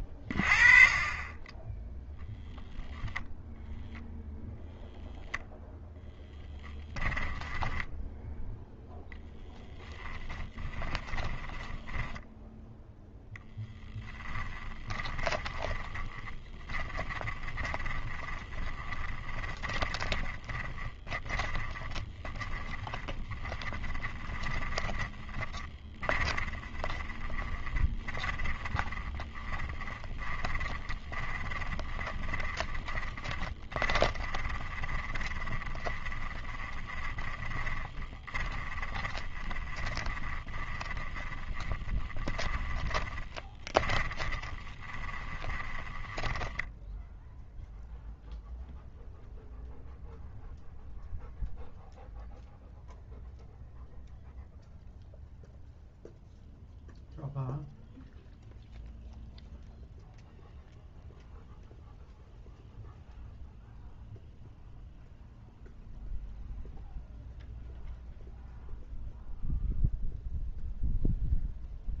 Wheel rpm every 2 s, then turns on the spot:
30, 0, 0, 10, 0, 10, 0, 20, 20, 20, 20, 20, 20, 20, 20, 20, 20, 30, 20, 20, 20, 20, 20, 20, 0, 0, 0, 0, 0, 0, 0, 0, 0, 0, 0, 0.
6-8 10-12 14-48